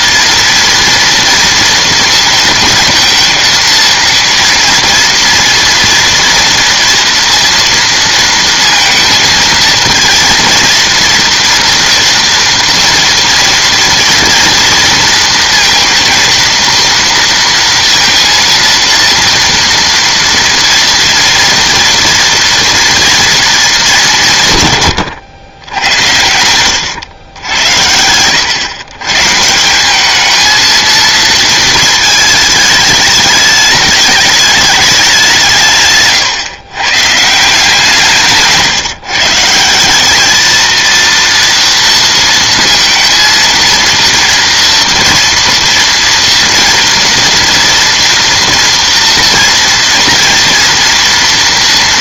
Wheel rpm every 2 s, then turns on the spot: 230, 230, 230, 230, 230, 230, 230, 230, 230, 230, 230, 230, 140, 100, 120, 230, 220, 210, 130, 150, 230, 230, 230, 230, 230, 240.
none